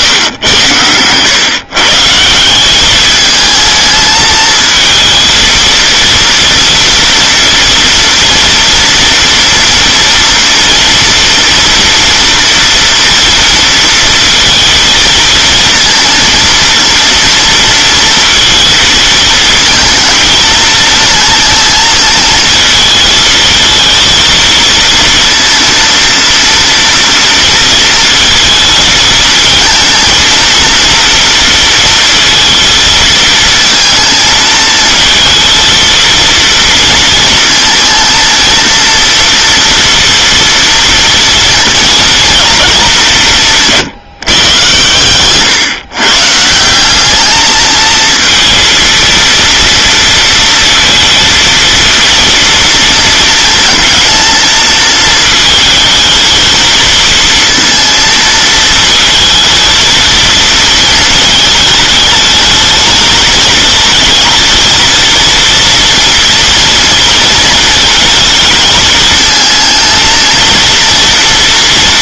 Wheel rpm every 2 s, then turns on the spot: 120, 180, 220, 230, 240, 230, 230, 230, 230, 230, 220, 220, 230, 230, 220, 230, 230, 220, 240, 230, 240, 220, 120, 170, 230, 230, 230, 220, 220, 220, 230, 220, 230, 230, 220, 230.
none